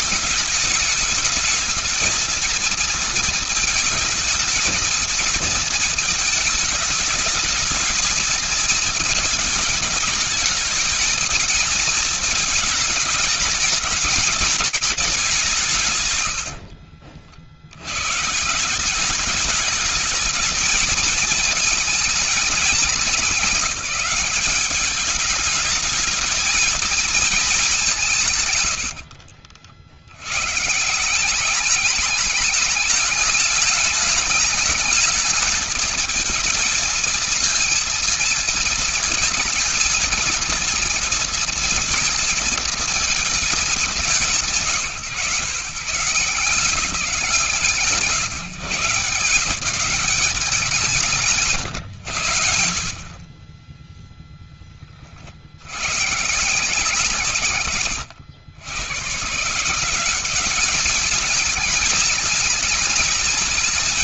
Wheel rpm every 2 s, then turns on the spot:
210, 230, 220, 220, 230, 220, 220, 220, 70, 170, 220, 220, 200, 220, 110, 160, 210, 220, 230, 220, 230, 230, 130, 170, 140, 180, 50, 30, 160, 100, 210, 220.
16-18 28-30 50-52